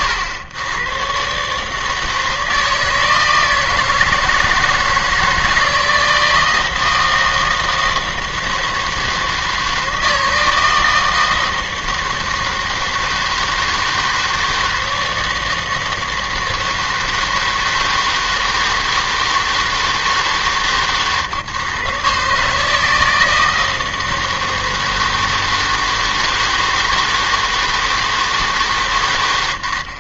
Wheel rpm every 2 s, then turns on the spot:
100, 160, 160, 160, 160, 160, 160, 160, 160, 160, 140, 160, 160, 160, 140.
none